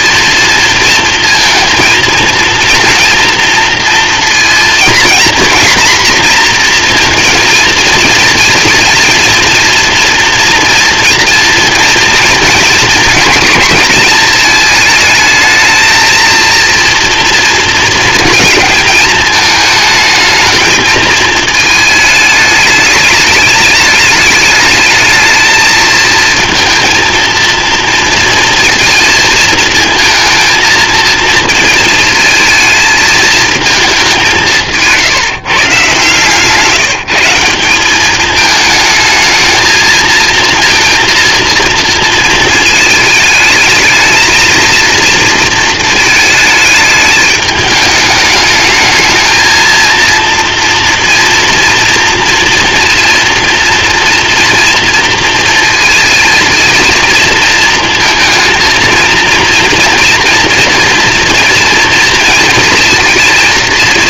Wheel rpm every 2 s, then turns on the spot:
230, 230, 230, 230, 230, 230, 230, 220, 230, 220, 220, 210, 220, 230, 230, 230, 220, 150, 170, 220, 230, 220, 230, 210, 220, 230, 230, 230, 220, 230, 240, 230.
none